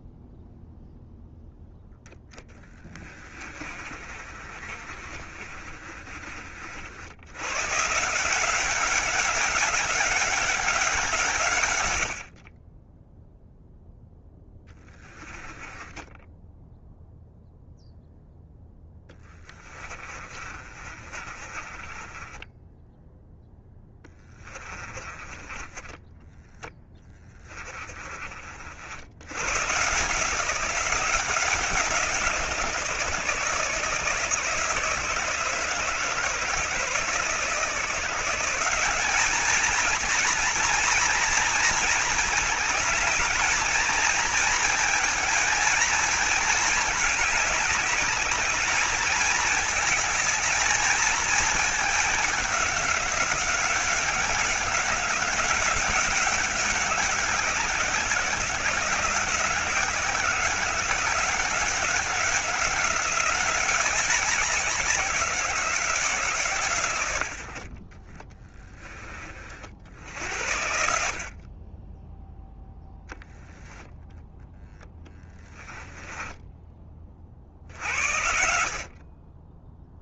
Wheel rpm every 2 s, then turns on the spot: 0, 10, 40, 60, 180, 190, 40, 10, 0, 10, 30, 10, 20, 10, 60, 170, 160, 160, 160, 190, 240, 220, 230, 210, 210, 220, 200, 190, 190, 180, 190, 190, 180, 130, 20, 70, 0, 0, 20, 50.
2-6 14-16 18-28